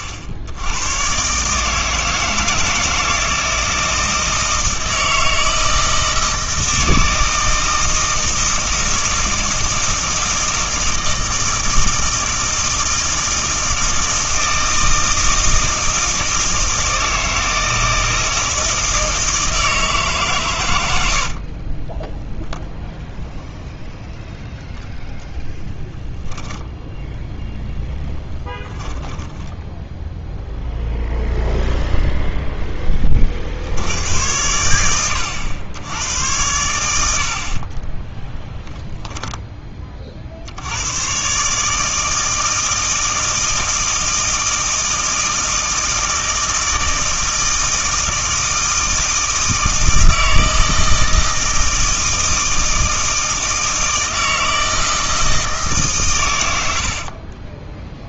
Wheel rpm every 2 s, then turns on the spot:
80, 160, 160, 160, 160, 160, 160, 160, 160, 160, 100, 0, 0, 0, 10, 0, 10, 100, 80, 10, 80, 160, 160, 160, 160, 160, 160, 160, 70.
28-30 56-58